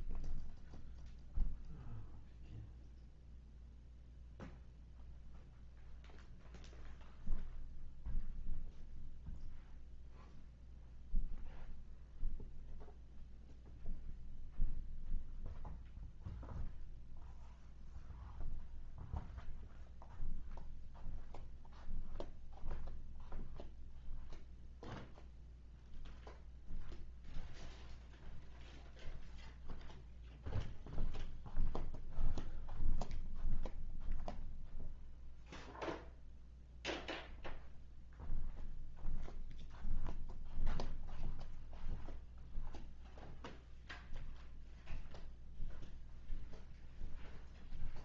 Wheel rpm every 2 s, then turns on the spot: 0, 0, 0, 0, 0, 0, 0, 0, 0, 0, 0, 0, 0, 0, 0, 0, 0, 0, 0, 0, 0, 0, 0, 0.
none